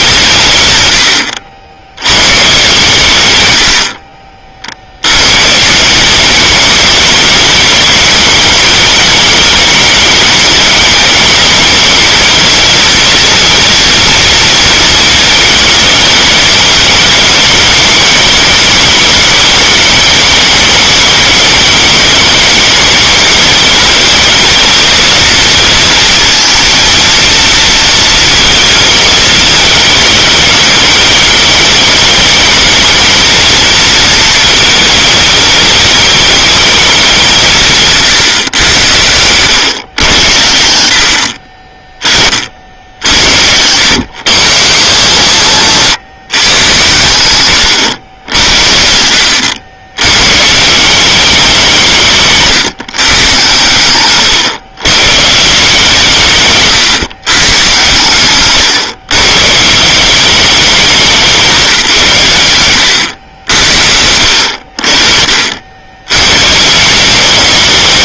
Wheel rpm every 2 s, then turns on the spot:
140, 140, 50, 210, 210, 210, 230, 220, 210, 210, 220, 200, 220, 230, 220, 200, 210, 220, 210, 110, 80, 40, 150, 130, 80, 140, 150, 130, 150, 130, 190, 110, 70, 150.
none